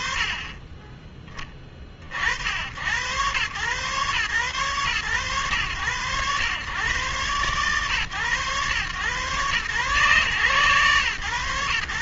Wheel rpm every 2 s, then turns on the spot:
20, 120, 110, 110, 120, 130.
none